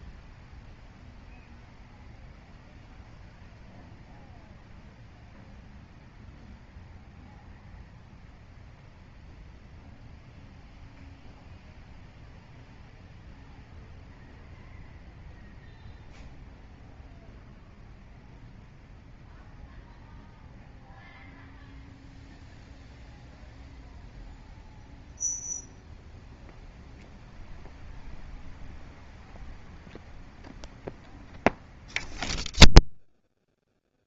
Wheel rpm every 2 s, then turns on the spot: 0, 0, 0, 0, 0, 0, 0, 0, 0, 0, 0, 0, 0, 0, 0, 0, 0.
none